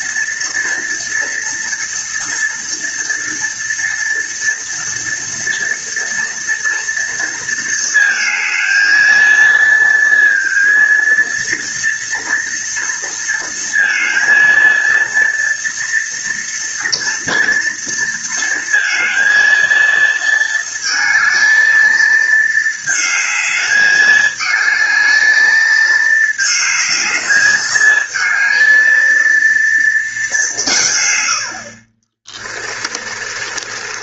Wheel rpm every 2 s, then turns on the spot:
230, 230, 230, 230, 220, 230, 230, 230, 230, 230, 220, 220, 220, 220, 220, 140, 30.
32-34